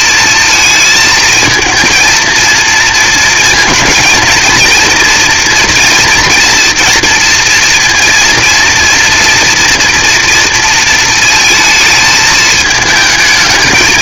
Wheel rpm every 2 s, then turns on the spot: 220, 230, 230, 230, 230, 230, 210.
none